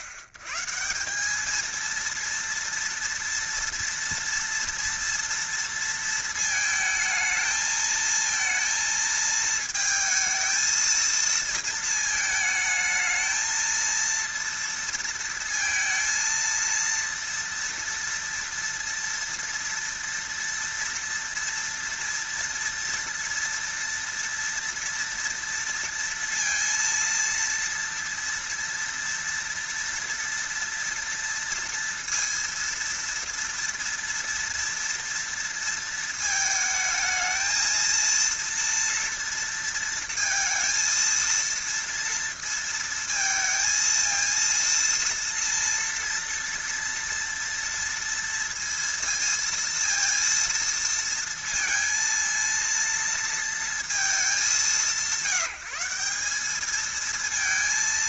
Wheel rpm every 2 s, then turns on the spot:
110, 230, 230, 220, 230, 230, 220, 230, 230, 230, 230, 230, 230, 230, 230, 230, 230, 230, 220, 230, 230, 230, 230, 230, 230, 230, 230, 170, 210.
none